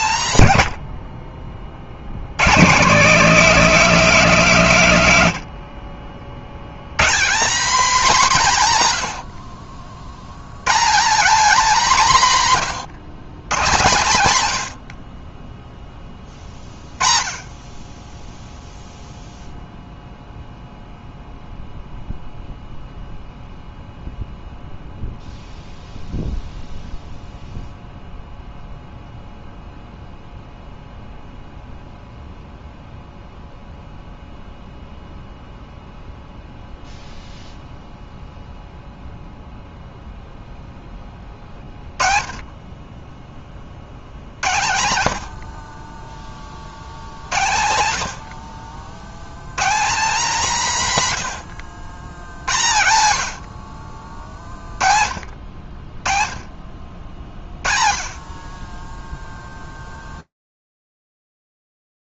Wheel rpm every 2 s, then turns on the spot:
80, 190, 170, 140, 120, 190, 150, 70, 10, 0, 0, 0, 0, 0, 0, 0, 0, 0, 0, 0, 10, 20, 90, 60, 70, 170, 90, 40, 50, 10, 0.
none